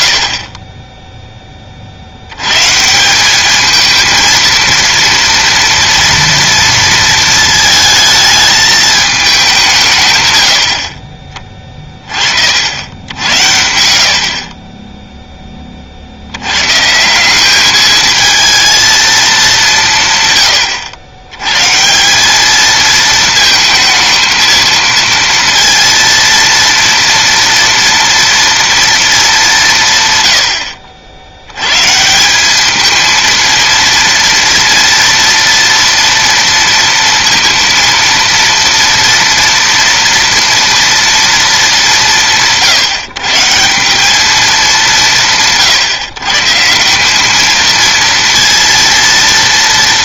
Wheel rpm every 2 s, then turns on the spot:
30, 160, 230, 230, 220, 80, 70, 30, 120, 220, 100, 220, 230, 230, 230, 60, 210, 230, 230, 230, 230, 160, 190, 170, 230.
none